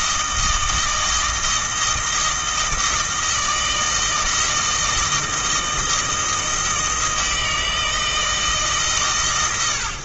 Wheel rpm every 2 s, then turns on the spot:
160, 160, 160, 160, 140.
none